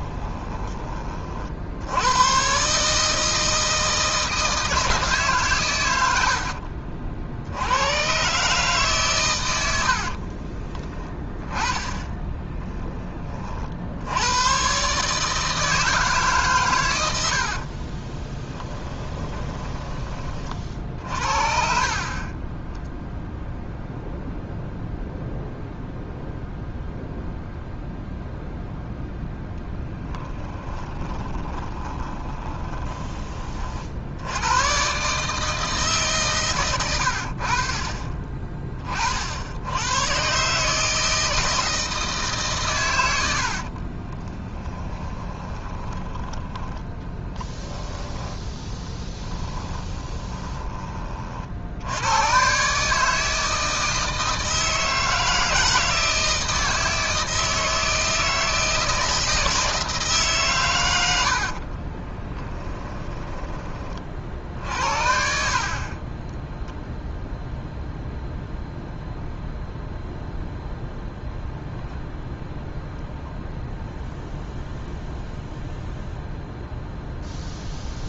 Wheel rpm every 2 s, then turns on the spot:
30, 150, 160, 50, 140, 20, 10, 140, 100, 20, 50, 10, 0, 0, 0, 20, 10, 130, 110, 30, 160, 100, 10, 10, 20, 30, 150, 160, 160, 160, 110, 20, 70, 0, 0, 0, 0, 0, 0.
18-20 30-32 44-46 48-50 62-66